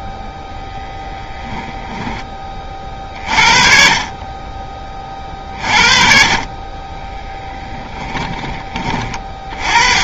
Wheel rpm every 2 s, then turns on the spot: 10, 30, 30, 20, 20.
0-2